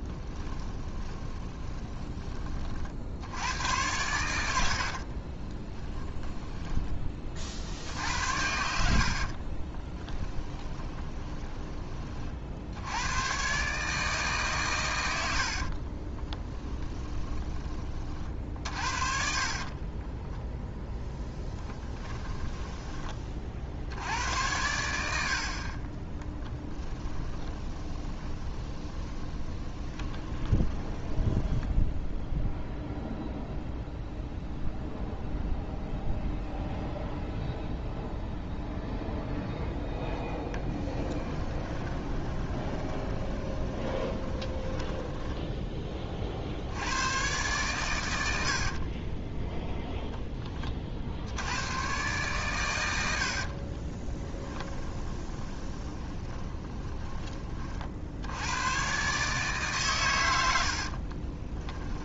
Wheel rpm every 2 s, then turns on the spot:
20, 60, 50, 10, 70, 20, 80, 120, 20, 50, 0, 20, 80, 20, 30, 20, 0, 0, 0, 0, 10, 20, 10, 100, 50, 40, 90, 20, 20, 130, 60.
0-2 4-6 8-12 16-20 26-32 40-46 48-50 54-58 60-62